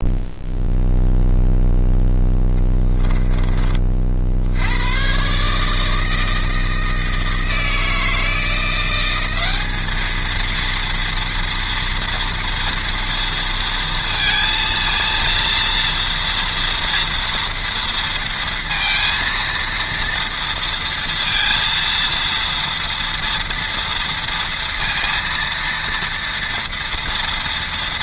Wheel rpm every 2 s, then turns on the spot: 0, 10, 80, 160, 170, 230, 230, 230, 230, 230, 230, 230, 230, 230.
2-4